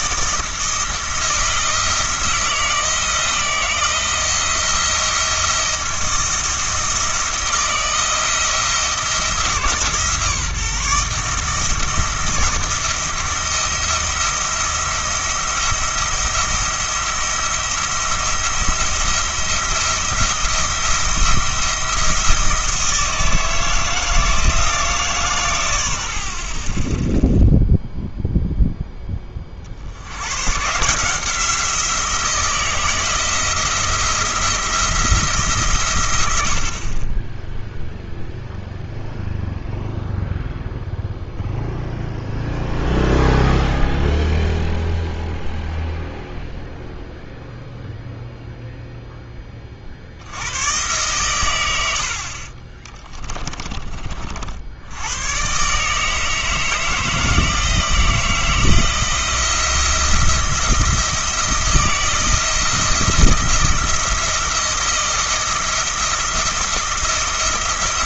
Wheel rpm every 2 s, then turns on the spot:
160, 160, 160, 160, 160, 150, 170, 160, 170, 170, 170, 160, 160, 20, 0, 150, 160, 170, 60, 0, 0, 0, 0, 0, 0, 110, 20, 80, 160, 160, 170, 170, 170, 170.
52-54